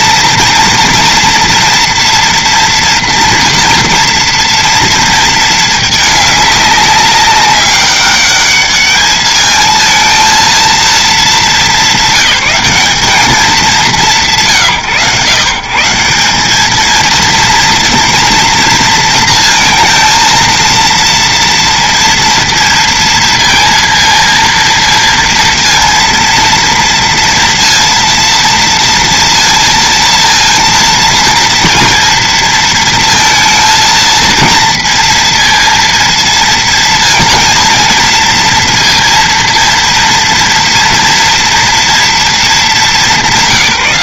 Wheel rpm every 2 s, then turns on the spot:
230, 230, 230, 200, 210, 230, 200, 150, 210, 230, 230, 230, 230, 230, 230, 230, 230, 230, 230, 230, 230, 210.
none